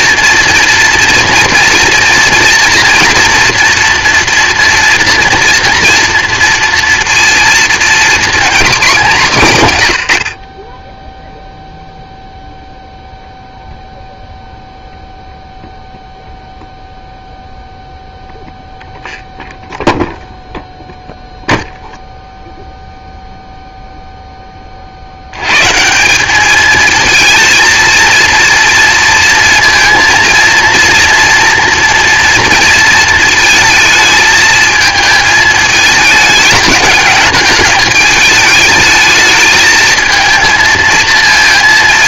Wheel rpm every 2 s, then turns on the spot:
230, 230, 240, 230, 230, 30, 0, 0, 0, 0, 0, 0, 30, 220, 230, 230, 230, 220, 210, 210, 230.
none